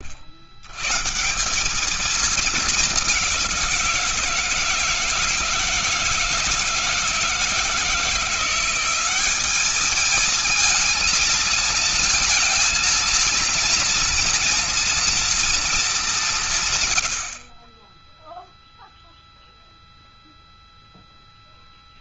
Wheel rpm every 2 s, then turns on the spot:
70, 220, 160, 160, 170, 220, 230, 230, 220, 0, 0.
none